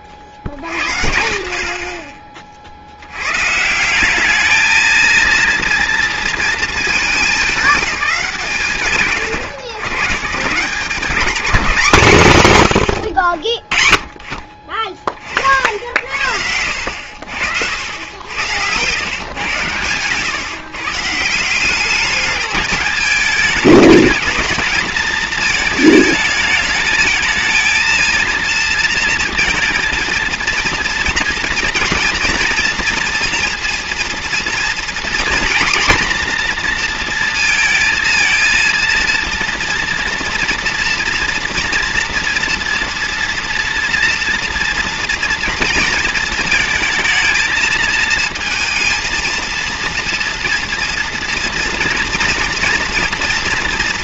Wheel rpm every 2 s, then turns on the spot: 40, 60, 220, 220, 110, 160, 90, 30, 70, 100, 140, 210, 220, 210, 230, 230, 240, 230, 230, 230, 230, 230, 230, 230, 230, 230, 230.
none